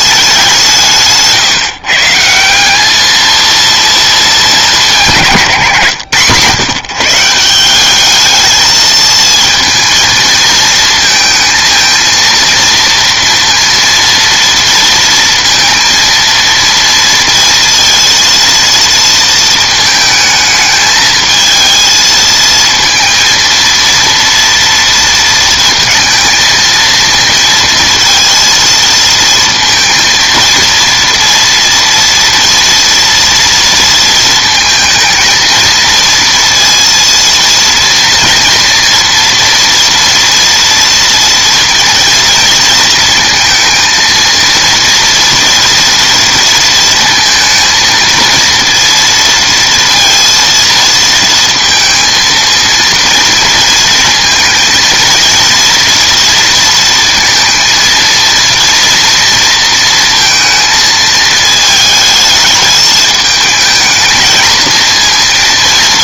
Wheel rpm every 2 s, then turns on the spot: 190, 180, 180, 150, 220, 220, 230, 230, 230, 230, 220, 230, 230, 230, 230, 230, 240, 220, 230, 230, 230, 230, 230, 230, 230, 230, 230, 230, 230, 230, 220, 220, 230.
none